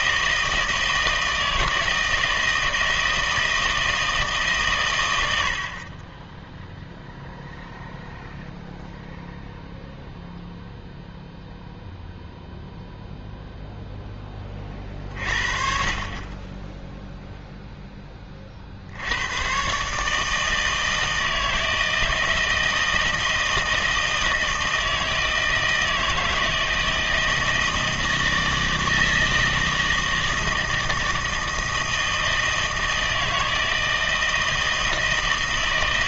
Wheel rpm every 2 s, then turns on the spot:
160, 160, 130, 0, 0, 0, 0, 30, 10, 50, 160, 160, 160, 160, 160, 160, 160, 160.
none